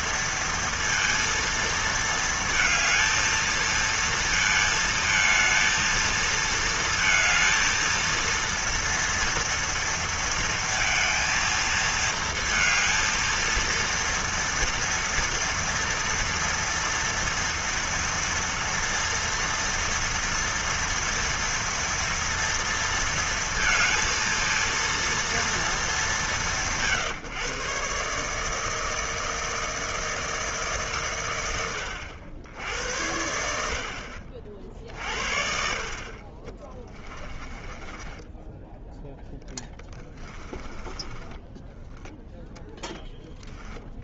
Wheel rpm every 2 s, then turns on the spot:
230, 220, 220, 230, 230, 230, 230, 230, 230, 230, 230, 230, 220, 200, 150, 160, 90, 50, 40, 10, 10, 10.
40-42